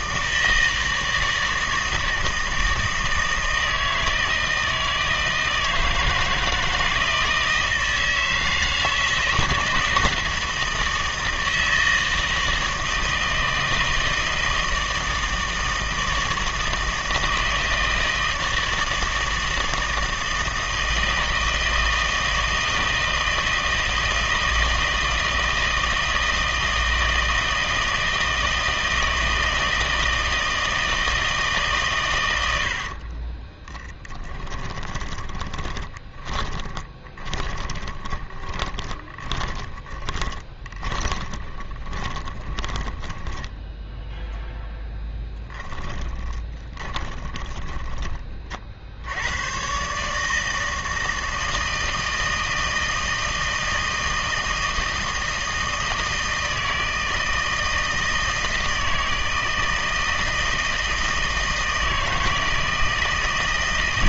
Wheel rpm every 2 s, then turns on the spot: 160, 160, 160, 160, 160, 160, 160, 160, 160, 160, 160, 160, 160, 160, 160, 160, 90, 20, 10, 20, 30, 20, 10, 20, 50, 160, 160, 160, 160, 160, 160, 160.
32-44 46-48